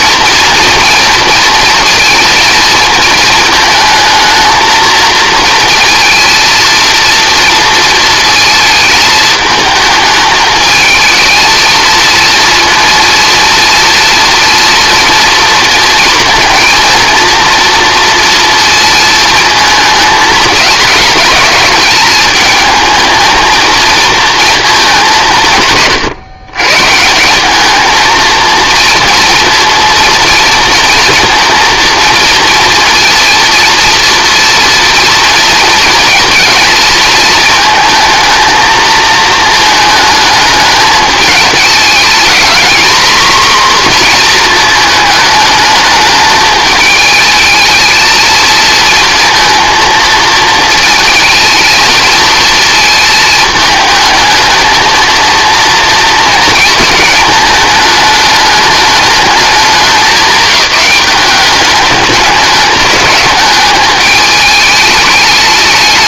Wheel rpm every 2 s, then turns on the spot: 230, 230, 220, 230, 220, 220, 230, 240, 230, 230, 220, 220, 210, 140, 230, 230, 230, 230, 230, 220, 210, 240, 220, 220, 230, 230, 220, 220, 220, 220, 190, 210, 210.
none